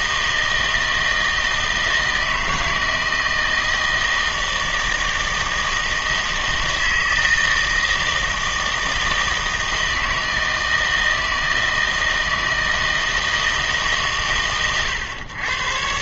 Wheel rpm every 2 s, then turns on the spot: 160, 160, 160, 160, 160, 160, 160, 120.
none